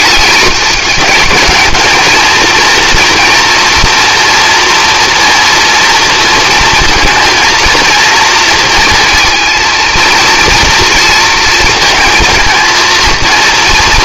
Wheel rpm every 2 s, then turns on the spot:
210, 230, 240, 230, 230, 220, 230.
none